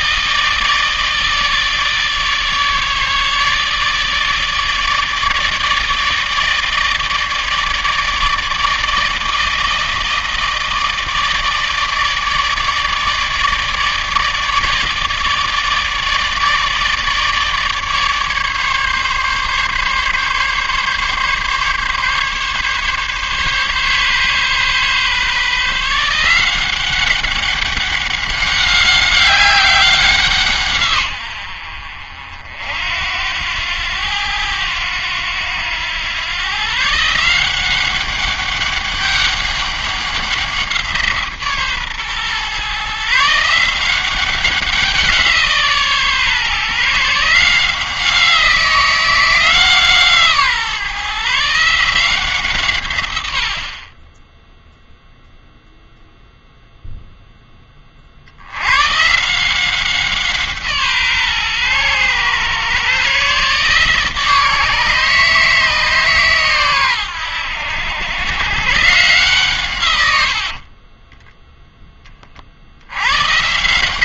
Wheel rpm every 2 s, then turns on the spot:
160, 150, 150, 160, 160, 160, 160, 150, 150, 150, 140, 140, 140, 180, 200, 150, 60, 90, 140, 200, 170, 130, 190, 140, 180, 150, 130, 0, 0, 100, 150, 130, 150, 120, 120, 50, 70.
none